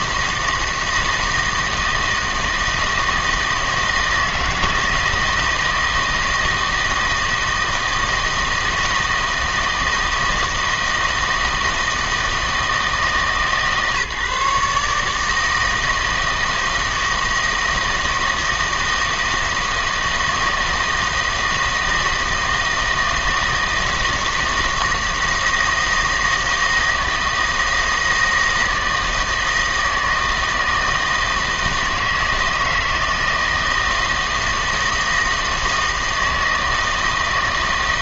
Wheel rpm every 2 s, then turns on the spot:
160, 160, 160, 160, 160, 160, 160, 150, 160, 160, 160, 160, 160, 160, 160, 160, 160, 160, 160.
none